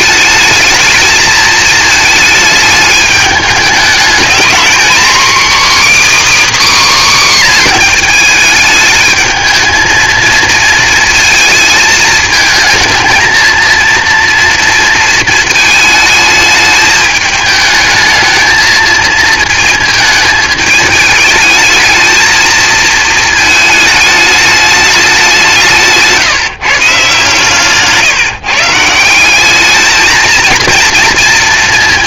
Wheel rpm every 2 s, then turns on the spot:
220, 220, 240, 300, 220, 230, 220, 230, 220, 220, 220, 220, 210, 150, 140, 230.
none